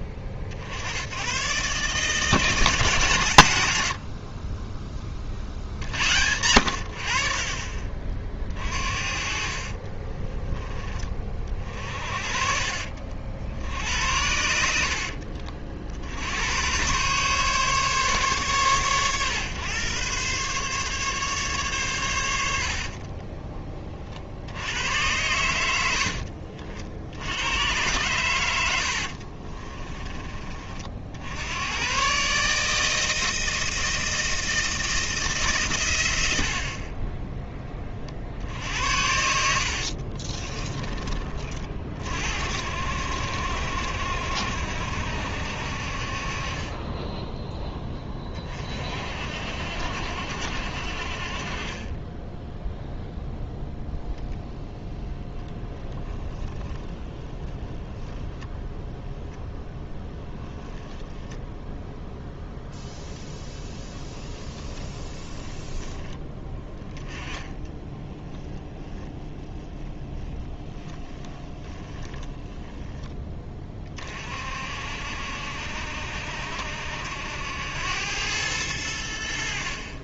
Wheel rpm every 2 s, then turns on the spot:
60, 160, 30, 90, 40, 10, 40, 70, 110, 110, 130, 70, 80, 50, 90, 40, 150, 160, 70, 60, 30, 60, 70, 30, 30, 60, 10, 10, 10, 0, 0, 0, 10, 10, 10, 10, 10, 50, 70, 100.
4-6 22-24 40-42 64-66 68-74